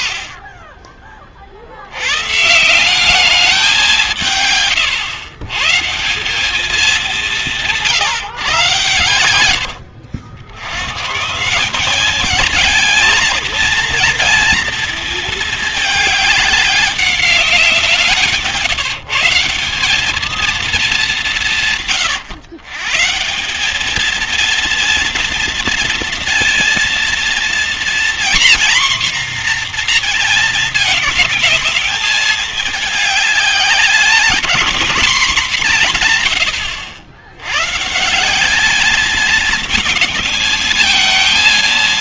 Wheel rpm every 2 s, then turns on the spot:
20, 180, 120, 190, 120, 100, 220, 230, 200, 160, 210, 140, 230, 230, 250, 220, 210, 220, 100, 220, 220.
none